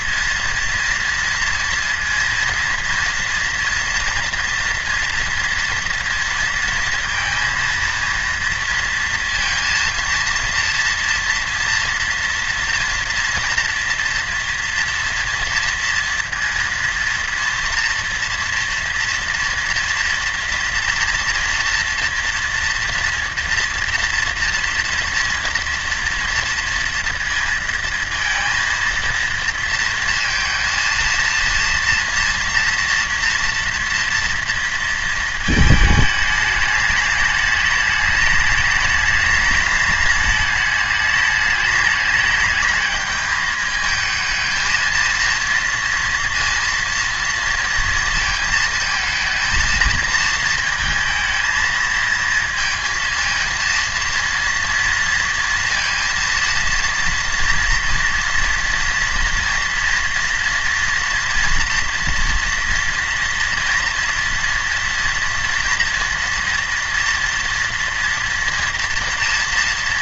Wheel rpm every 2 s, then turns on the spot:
230, 230, 240, 230, 230, 230, 230, 230, 230, 240, 230, 240, 230, 230, 230, 230, 230, 230, 210, 210, 210, 210, 220, 230, 220, 220, 230, 230, 230, 230, 240, 240, 240, 230, 230.
none